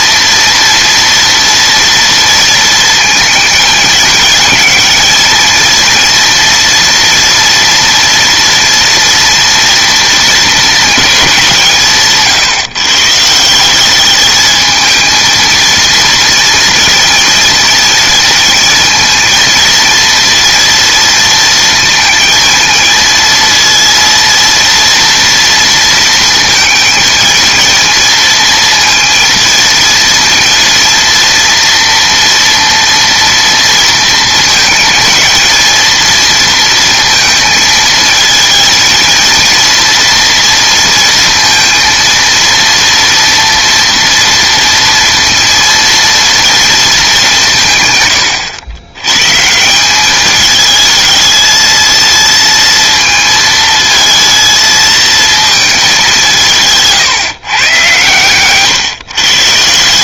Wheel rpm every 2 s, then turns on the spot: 230, 220, 220, 230, 230, 220, 130, 220, 230, 230, 230, 220, 230, 220, 230, 230, 230, 220, 230, 230, 230, 230, 230, 220, 100, 220, 230, 220, 150, 130.
none